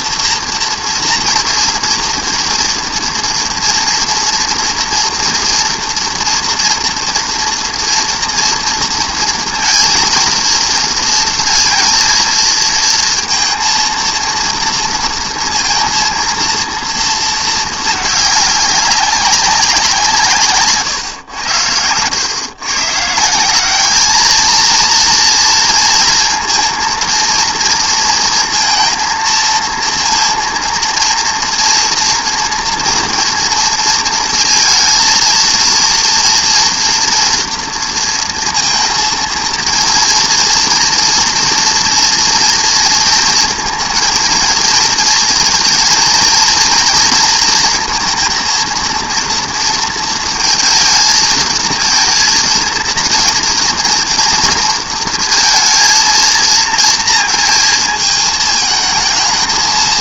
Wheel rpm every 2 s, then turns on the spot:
230, 230, 230, 230, 230, 230, 230, 230, 230, 190, 130, 140, 230, 230, 230, 230, 240, 230, 230, 230, 240, 230, 230, 240, 230, 220, 230, 230, 230, 220.
none